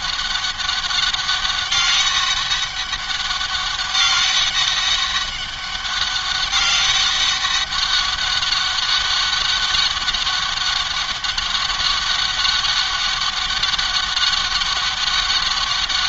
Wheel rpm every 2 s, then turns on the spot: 200, 200, 200, 200, 200, 200, 200, 190.
none